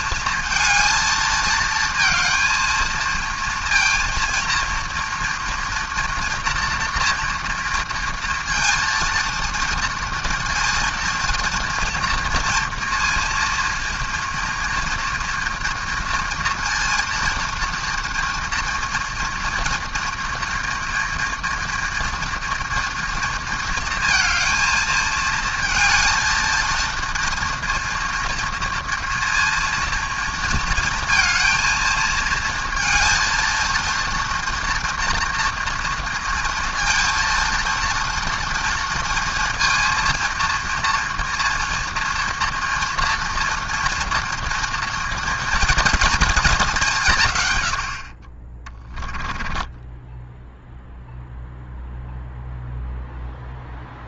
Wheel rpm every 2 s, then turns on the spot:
230, 230, 230, 230, 230, 230, 230, 240, 230, 230, 240, 230, 220, 230, 230, 230, 230, 230, 230, 230, 230, 230, 230, 190, 20, 0, 0.
48-50